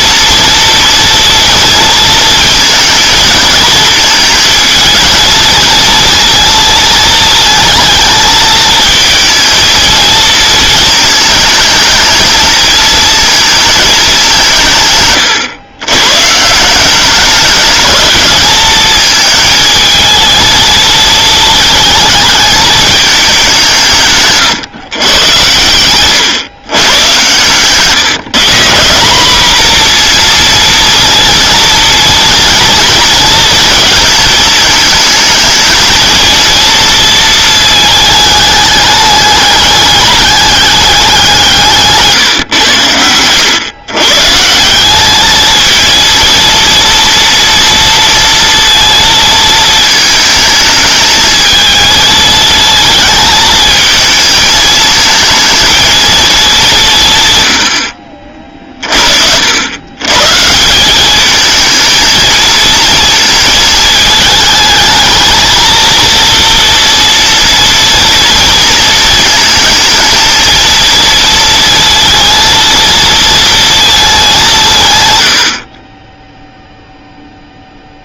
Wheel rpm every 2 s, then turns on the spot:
230, 230, 220, 230, 220, 220, 230, 170, 150, 210, 220, 220, 140, 120, 150, 230, 230, 220, 230, 210, 200, 120, 170, 230, 230, 220, 220, 220, 210, 50, 170, 230, 220, 230, 230, 230, 230, 170, 0.
none